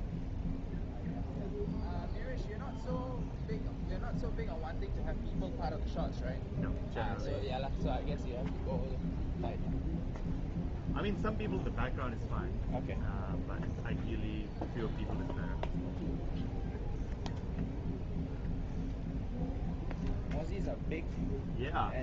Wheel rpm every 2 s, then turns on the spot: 0, 0, 0, 0, 0, 0, 0, 0, 0, 0, 0.
none